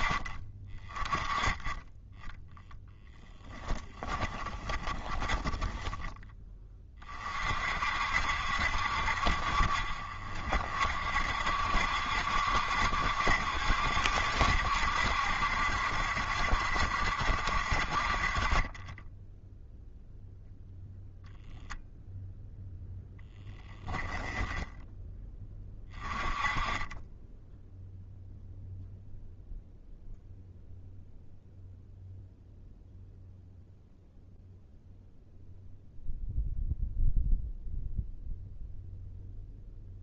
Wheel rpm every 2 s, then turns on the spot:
10, 20, 10, 60, 40, 60, 70, 70, 50, 0, 0, 10, 20, 0, 0, 0, 0, 0, 0, 0.
2-4 22-24